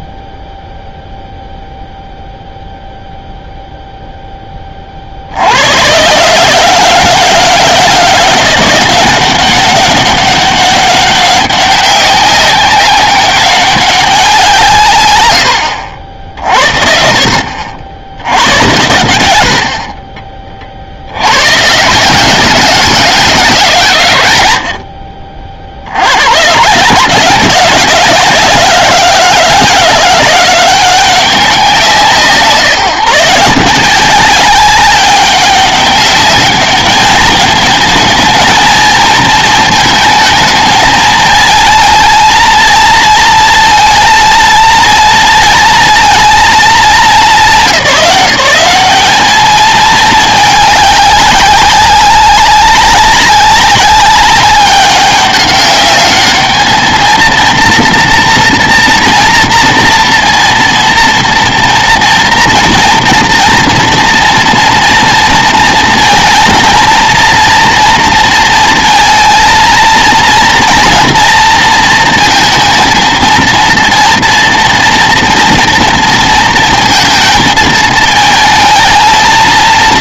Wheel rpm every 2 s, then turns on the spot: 0, 0, 20, 150, 180, 200, 200, 160, 60, 110, 40, 180, 90, 120, 160, 180, 170, 190, 210, 220, 220, 230, 230, 230, 180, 210, 200, 200, 220, 230, 230, 230, 230, 230, 230, 230, 230, 240, 230, 220.
none